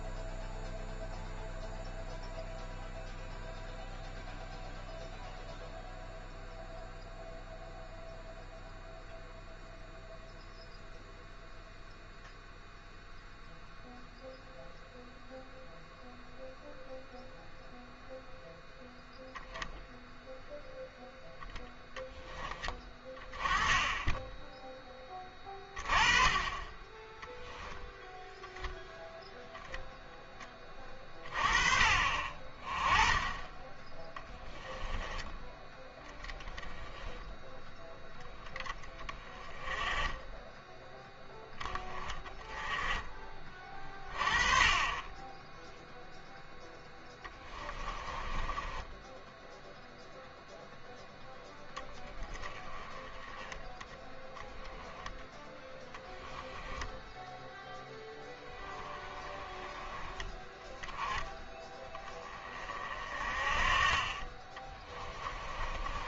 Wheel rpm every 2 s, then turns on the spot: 0, 0, 0, 0, 0, 0, 0, 0, 0, 0, 0, 30, 10, 20, 0, 30, 20, 10, 10, 10, 10, 10, 30, 10, 10, 0, 10, 10, 0, 10, 10, 30, 30.
40-42 46-50 64-66